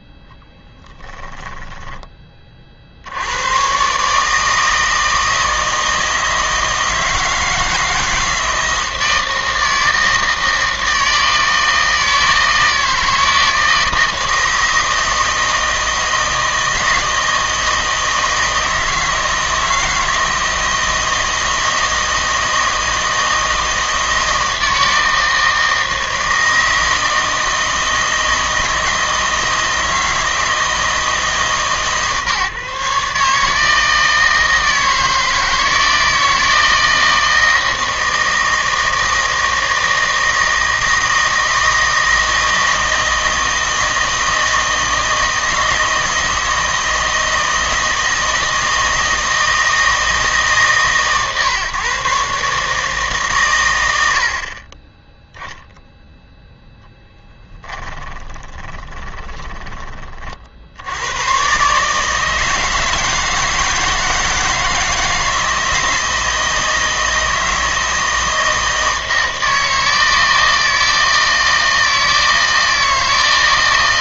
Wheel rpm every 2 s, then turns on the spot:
10, 50, 160, 160, 160, 160, 160, 160, 160, 160, 160, 160, 160, 160, 160, 160, 150, 160, 160, 160, 160, 160, 160, 160, 160, 150, 150, 30, 0, 20, 70, 160, 160, 160, 160, 160, 160.
0-2 58-60